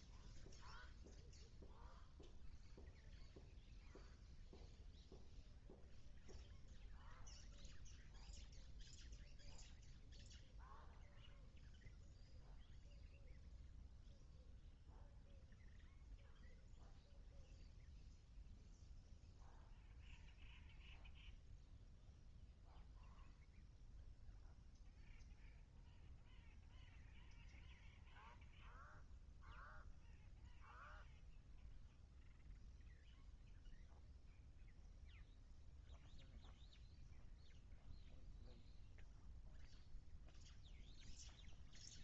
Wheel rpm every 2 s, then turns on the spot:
0, 0, 0, 0, 0, 0, 0, 0, 0, 0, 0, 0, 0, 0, 0, 0, 0, 0, 0, 0, 0.
none